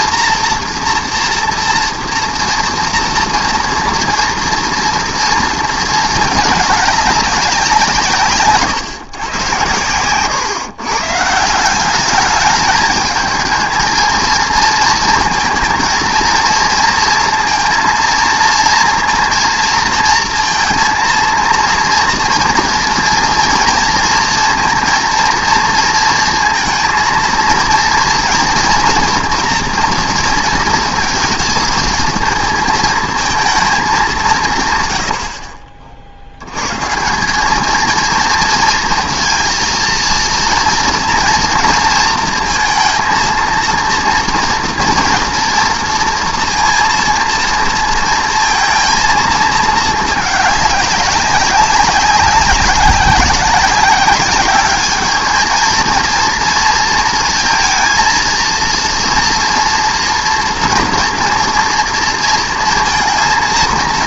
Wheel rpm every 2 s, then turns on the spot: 230, 230, 230, 210, 140, 120, 220, 230, 230, 230, 230, 230, 230, 230, 240, 230, 220, 140, 120, 230, 230, 230, 240, 230, 230, 200, 190, 210, 230, 230, 230, 230.
none